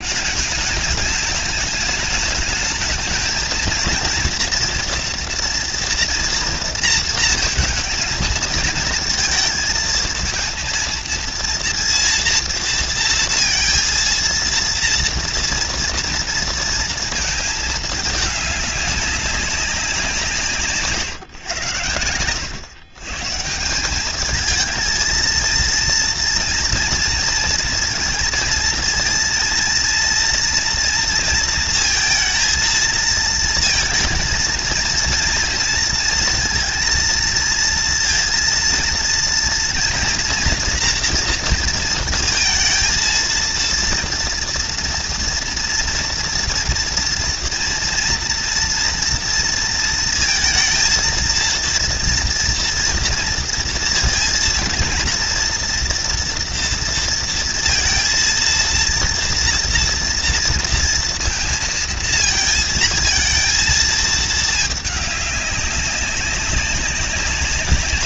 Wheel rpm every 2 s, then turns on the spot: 210, 210, 230, 240, 220, 230, 230, 230, 230, 220, 160, 90, 210, 230, 230, 230, 230, 230, 230, 230, 240, 230, 230, 230, 230, 230, 230, 230, 240, 230, 230, 230, 220, 200.
none